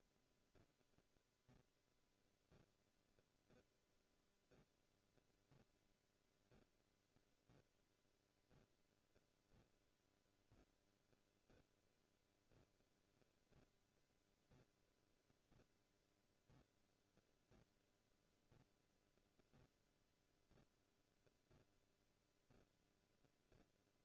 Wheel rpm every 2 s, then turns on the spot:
0, 0, 0, 0, 0, 0, 0, 0, 0, 0, 0, 0.
none